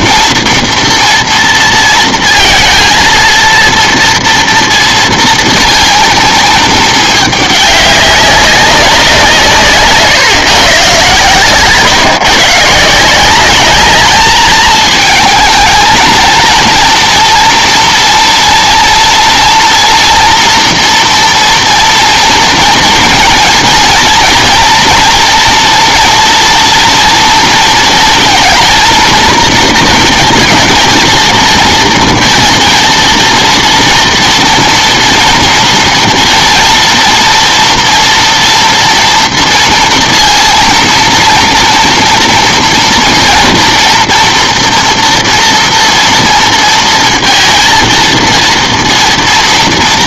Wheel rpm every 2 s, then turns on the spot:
230, 230, 230, 220, 190, 130, 160, 220, 230, 230, 230, 230, 240, 230, 230, 220, 230, 230, 230, 230, 230, 230, 230, 230, 230.
none